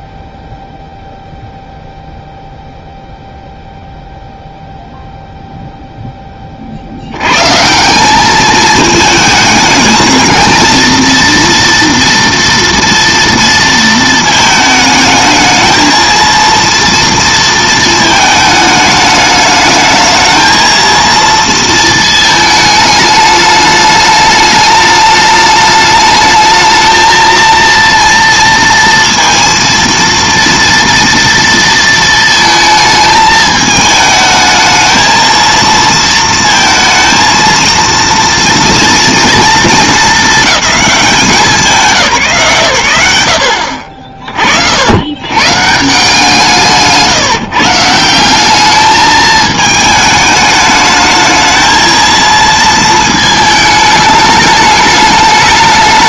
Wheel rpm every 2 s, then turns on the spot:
0, 0, 0, 20, 210, 230, 230, 220, 230, 220, 220, 220, 210, 220, 230, 230, 220, 220, 230, 230, 220, 140, 50, 170, 190, 210, 220, 210.
none